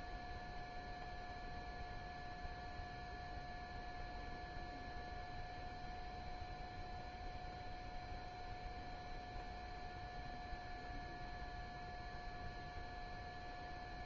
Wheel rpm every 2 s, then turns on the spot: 0, 0, 0, 0, 0, 0, 0.
none